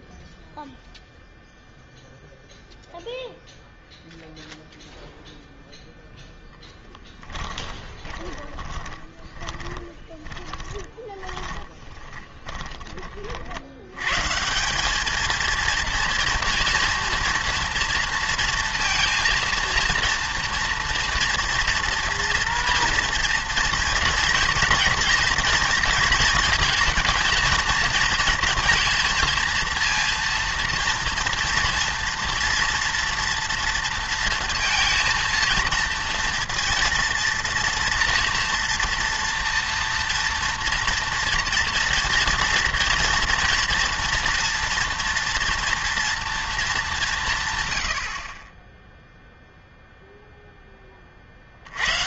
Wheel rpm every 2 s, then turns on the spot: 0, 0, 0, 0, 20, 20, 20, 170, 230, 230, 240, 230, 230, 220, 230, 230, 230, 230, 230, 240, 240, 230, 230, 210, 10, 10.
8-14